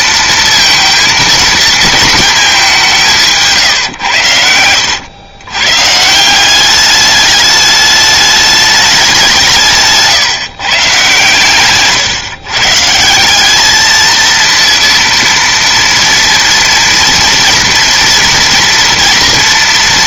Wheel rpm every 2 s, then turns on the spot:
230, 190, 90, 200, 210, 150, 140, 230, 230, 230.
none